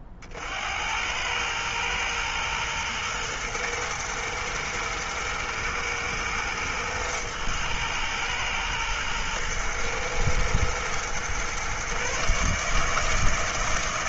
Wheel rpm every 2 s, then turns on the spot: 60, 110, 120, 110, 110, 120, 140.
none